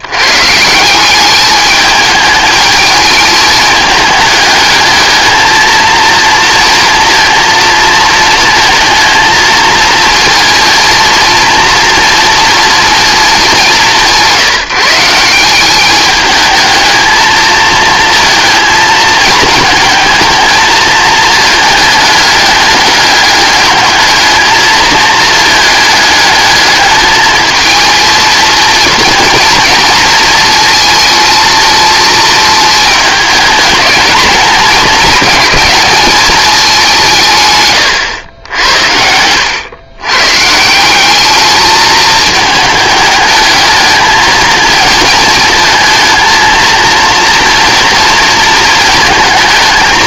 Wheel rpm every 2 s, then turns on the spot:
160, 210, 210, 230, 230, 230, 240, 180, 220, 220, 220, 210, 220, 210, 230, 220, 220, 220, 180, 70, 180, 210, 220, 230, 220.
none